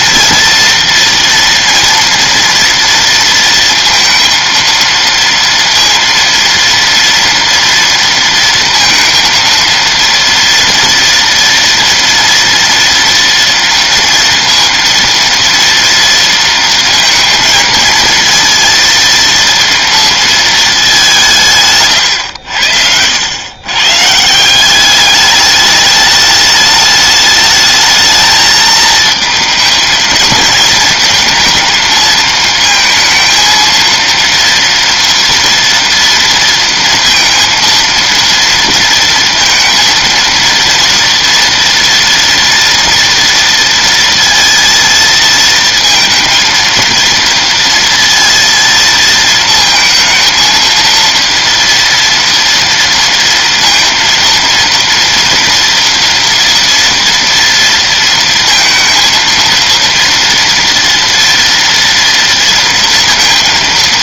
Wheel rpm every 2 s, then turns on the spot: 230, 230, 230, 230, 230, 230, 230, 230, 230, 230, 220, 90, 180, 210, 220, 230, 220, 230, 230, 230, 230, 230, 230, 230, 230, 230, 230, 230, 230, 230, 230, 230.
none